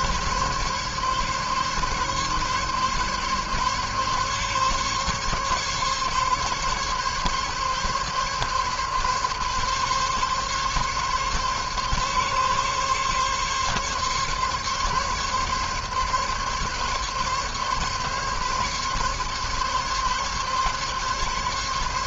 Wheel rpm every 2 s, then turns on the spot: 140, 140, 140, 140, 140, 140, 140, 140, 140, 140, 140.
none